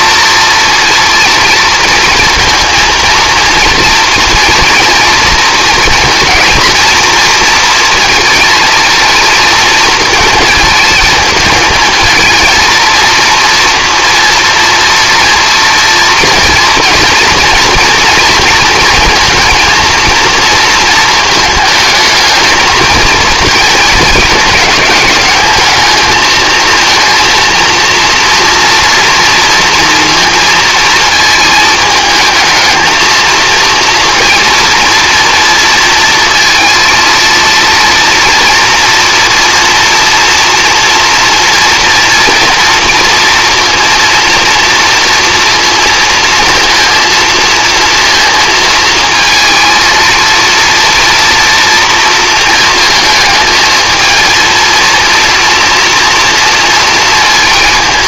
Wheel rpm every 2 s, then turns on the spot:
230, 230, 230, 230, 230, 220, 230, 230, 230, 230, 230, 220, 210, 230, 240, 230, 220, 230, 230, 230, 240, 230, 230, 230, 220, 230, 220, 230, 230.
none